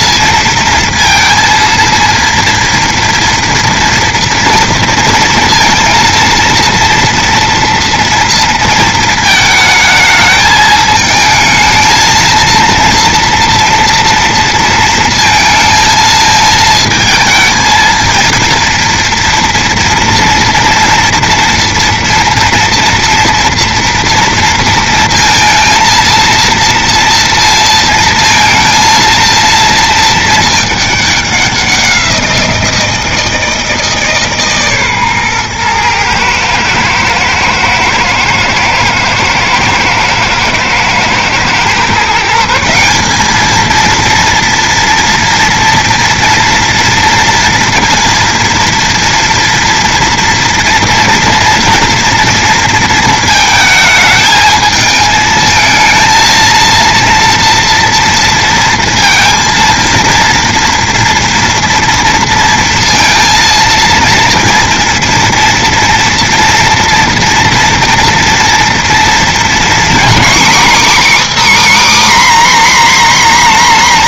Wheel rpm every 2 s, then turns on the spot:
230, 230, 230, 230, 230, 220, 230, 230, 220, 230, 240, 240, 230, 230, 230, 220, 170, 140, 120, 110, 120, 170, 240, 230, 230, 230, 230, 220, 230, 230, 230, 230, 230, 240, 240, 280, 280.
none